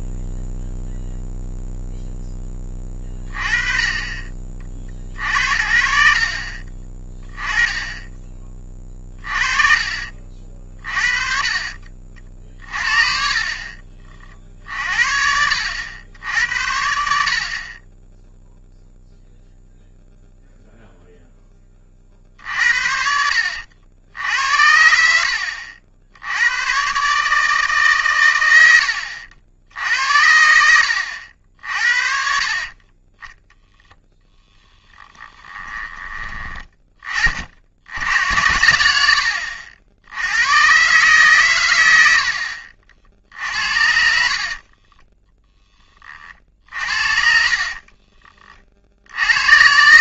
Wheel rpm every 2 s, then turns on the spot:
0, 20, 40, 30, 30, 40, 60, 60, 80, 0, 0, 60, 70, 120, 100, 80, 30, 10, 30, 90, 130, 60, 30, 50, 50.
6-10 24-26 34-36 44-46